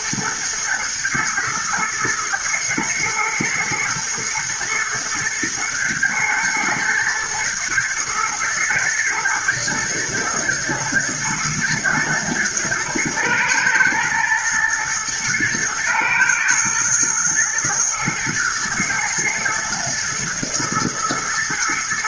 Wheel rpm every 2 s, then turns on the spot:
120, 110, 110, 120, 110, 120, 110, 110, 120, 110, 120.
none